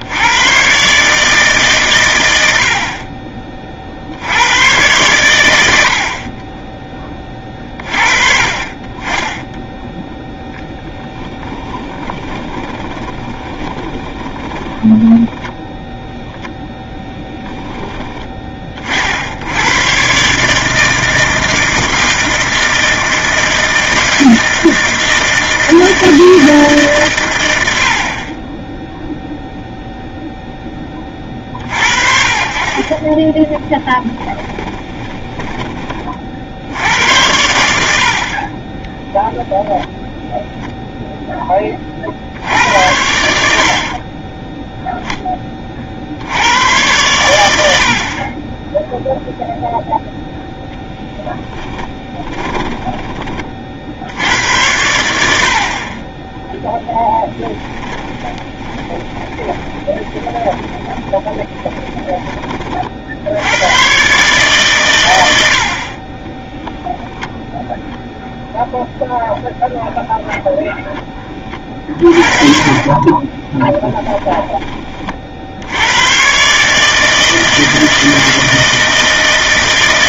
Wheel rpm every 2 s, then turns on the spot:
100, 80, 100, 20, 30, 10, 20, 30, 10, 30, 150, 160, 160, 160, 20, 10, 40, 10, 70, 30, 0, 80, 10, 90, 20, 10, 30, 90, 10, 20, 20, 30, 140, 10, 0, 0, 40, 20, 130, 160.
12-16 34-36 52-54 58-62 66-68 72-76